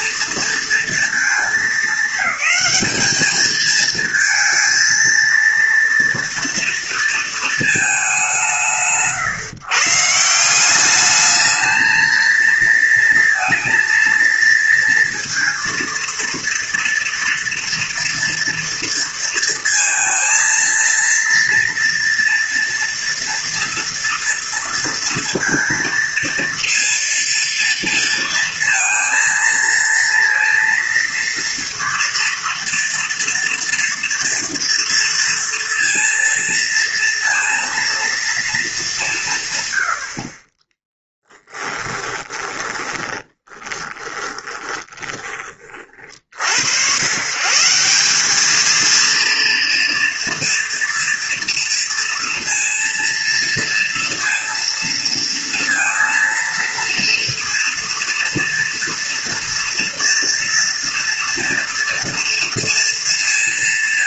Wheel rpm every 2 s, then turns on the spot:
230, 210, 230, 240, 140, 190, 230, 230, 230, 230, 230, 230, 230, 230, 230, 230, 230, 230, 230, 210, 20, 30, 20, 90, 220, 240, 230, 230, 230, 230, 230, 230.
40-46